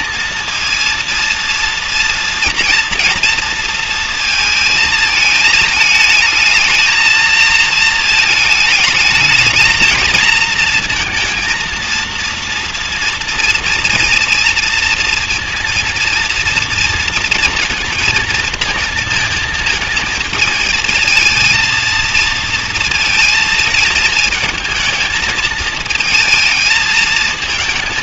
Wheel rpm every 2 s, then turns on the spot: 230, 240, 220, 220, 220, 230, 230, 230, 230, 230, 220, 230, 220, 220.
none